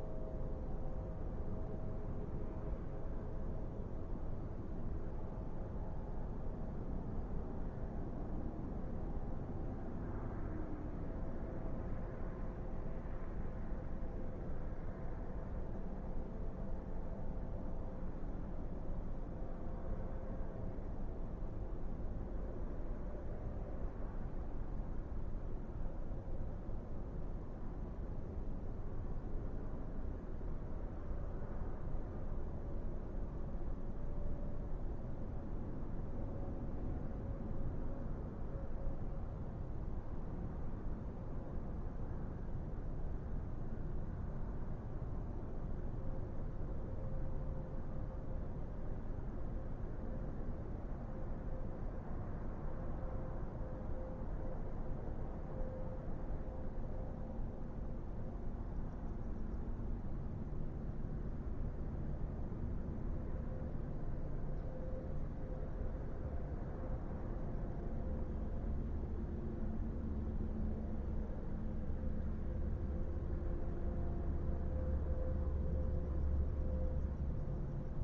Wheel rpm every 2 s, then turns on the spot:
0, 0, 0, 0, 0, 0, 0, 0, 0, 0, 0, 0, 0, 0, 0, 0, 0, 0, 0, 0, 0, 0, 0, 0, 0, 0, 0, 0, 0, 0, 0, 0, 0, 0, 0, 0, 0, 0, 0.
none